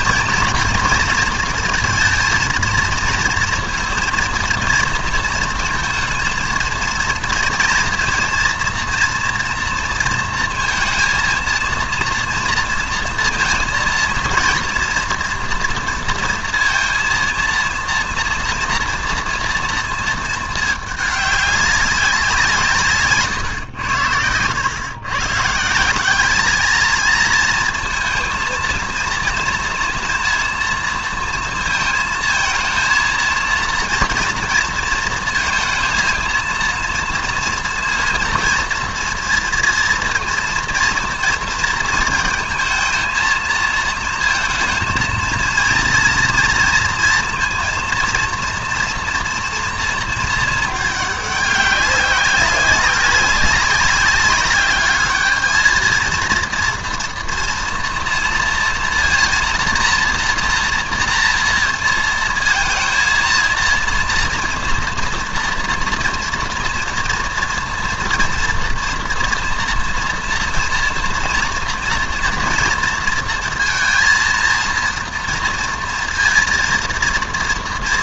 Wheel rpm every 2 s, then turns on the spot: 230, 230, 230, 230, 230, 230, 230, 230, 230, 230, 210, 150, 120, 220, 230, 230, 230, 230, 230, 230, 230, 230, 220, 230, 230, 210, 190, 210, 230, 230, 230, 230, 230, 230, 230, 230, 230, 230, 230.
none